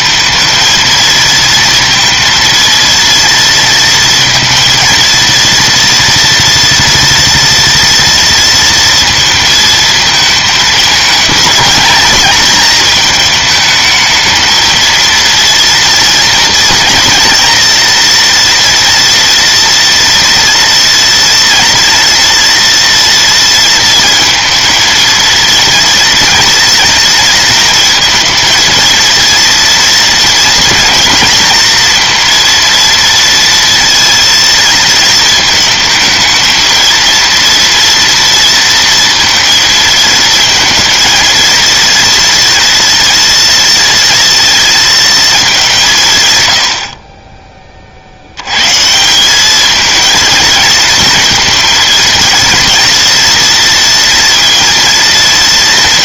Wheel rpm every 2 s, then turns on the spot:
220, 230, 230, 230, 230, 220, 220, 220, 230, 240, 230, 230, 220, 230, 230, 230, 230, 230, 230, 230, 230, 230, 230, 70, 140, 220, 230, 230.
none